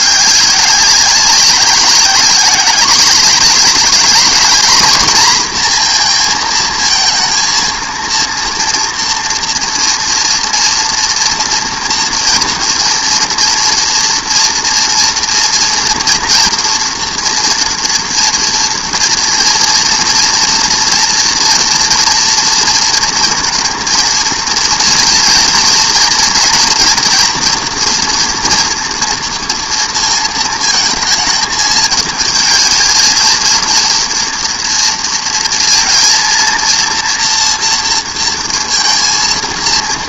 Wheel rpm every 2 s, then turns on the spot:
190, 200, 230, 230, 230, 230, 240, 230, 230, 230, 230, 230, 230, 240, 230, 220, 220, 230, 230, 230.
none